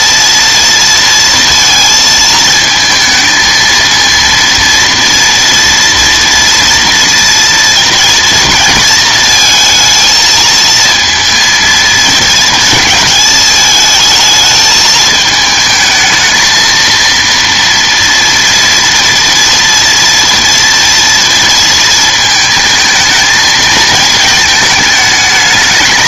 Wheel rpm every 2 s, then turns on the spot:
230, 220, 230, 230, 230, 230, 220, 220, 220, 230, 230, 220, 220.
none